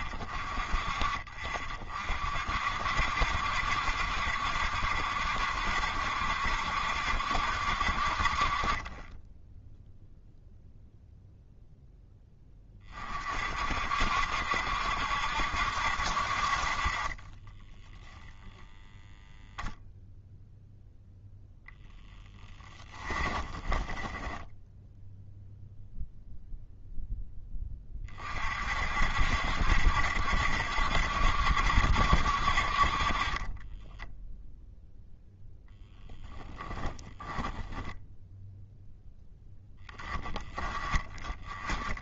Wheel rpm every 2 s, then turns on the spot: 40, 60, 60, 60, 0, 0, 50, 70, 10, 0, 0, 20, 0, 20, 70, 70, 10, 10, 10, 10, 20.
16-18 22-24 32-34 36-38